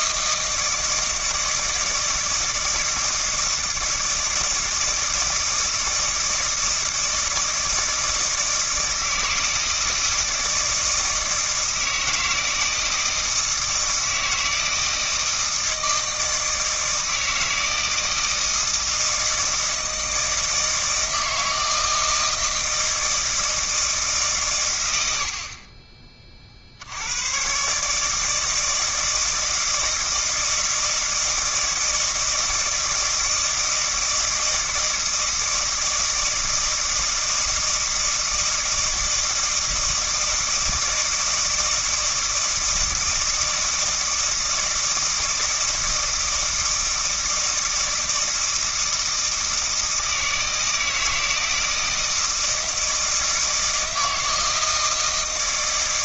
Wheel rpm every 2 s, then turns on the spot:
160, 160, 160, 160, 160, 160, 160, 160, 160, 160, 160, 160, 110, 60, 160, 160, 160, 160, 160, 160, 160, 160, 160, 160, 160, 160, 160, 160.
none